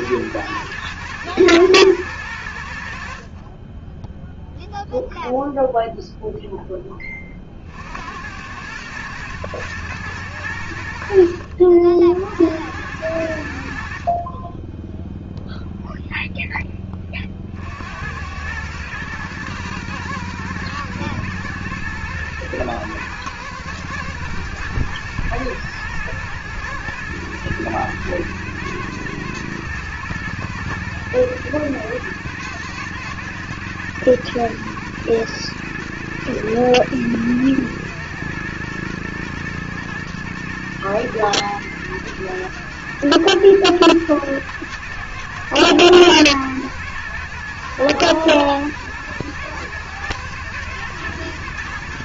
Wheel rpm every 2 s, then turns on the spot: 120, 100, 0, 0, 90, 90, 80, 30, 10, 100, 110, 110, 120, 120, 120, 120, 110, 110, 120, 120, 110, 110, 110, 110, 110, 120.
none